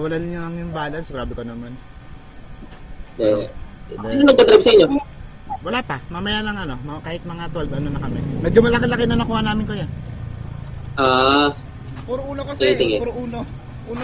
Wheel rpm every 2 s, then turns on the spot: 0, 0, 0, 0, 0, 0, 0.
none